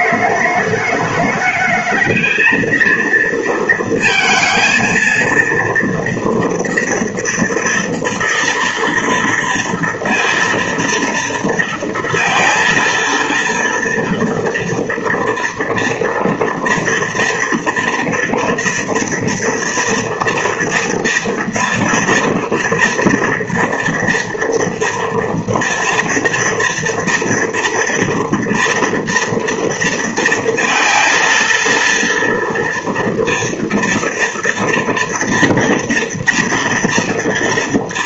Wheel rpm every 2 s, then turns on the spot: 210, 220, 230, 230, 230, 230, 230, 240, 230, 230, 230, 230, 230, 230, 230, 230, 230, 240, 240.
none